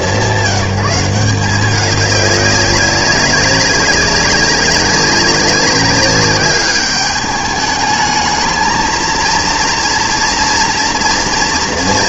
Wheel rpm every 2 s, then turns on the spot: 200, 200, 200, 210, 230, 230.
none